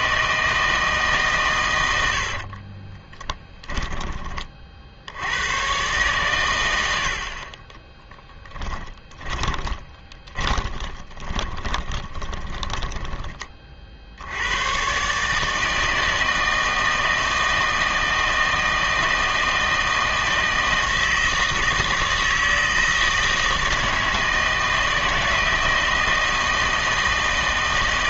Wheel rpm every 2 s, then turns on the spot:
160, 50, 40, 100, 10, 20, 20, 100, 160, 160, 160, 160, 160, 160.
2-4 8-14